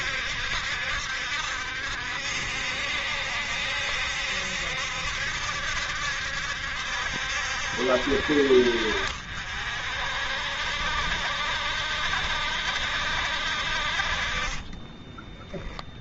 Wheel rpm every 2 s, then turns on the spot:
70, 70, 70, 70, 50, 60, 70, 20.
14-16